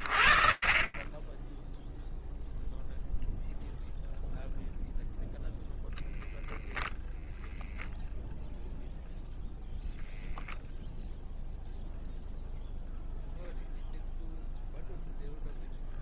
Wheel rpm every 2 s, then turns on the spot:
20, 0, 0, 0, 0, 0, 0, 0.
none